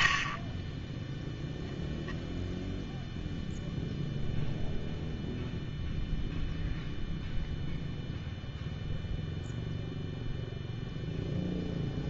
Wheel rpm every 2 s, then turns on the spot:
10, 0, 0, 0, 0, 0.
none